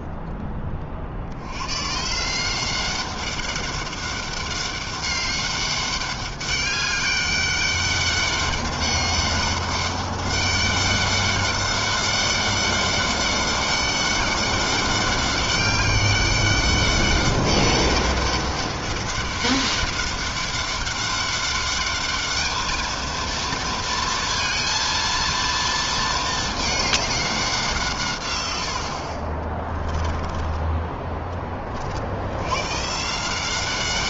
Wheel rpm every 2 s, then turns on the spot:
80, 200, 200, 200, 200, 200, 200, 200, 200, 200, 200, 230, 230, 190, 40, 30, 180.
28-30